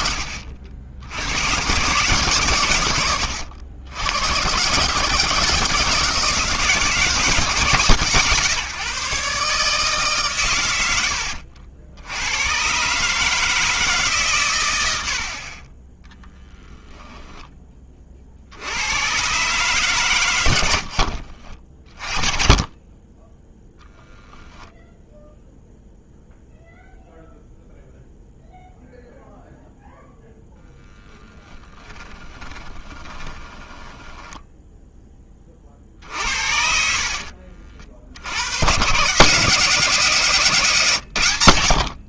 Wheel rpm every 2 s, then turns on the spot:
60, 120, 130, 160, 140, 100, 120, 110, 10, 80, 90, 30, 0, 0, 0, 0, 20, 10, 60, 100, 150.
16-18 20-22 32-34 36-38